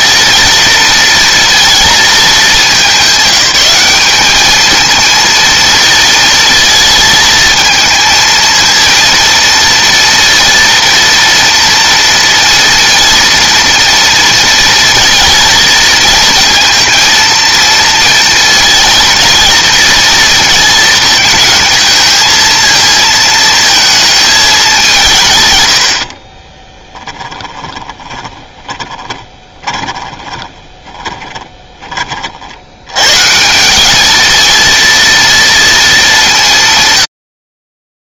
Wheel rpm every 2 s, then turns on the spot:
230, 210, 210, 230, 220, 230, 230, 230, 230, 230, 230, 220, 220, 40, 20, 20, 50, 220, 190.
26-32